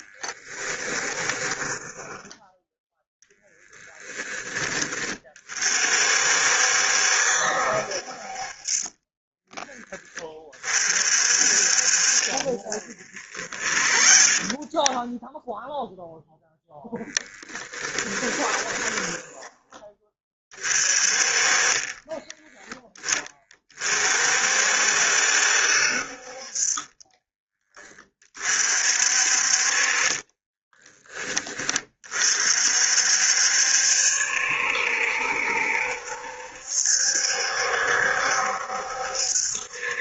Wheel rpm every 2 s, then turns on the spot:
20, 0, 20, 70, 20, 40, 40, 10, 0, 20, 30, 10, 60, 30, 50, 20, 60, 70, 70, 60.
0-2 8-10 12-16 18-20 26-28